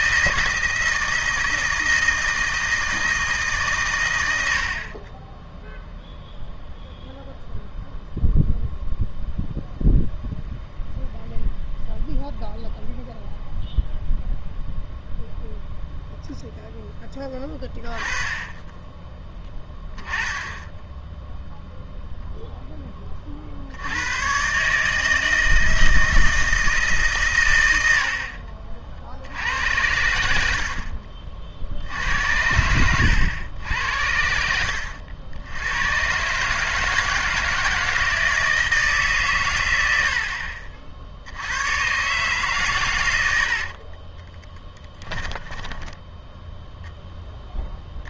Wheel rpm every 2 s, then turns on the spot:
160, 160, 70, 0, 0, 0, 0, 0, 10, 10, 10, 10, 150, 150, 40, 60, 90, 80, 150, 160, 60, 130, 10, 0.
44-46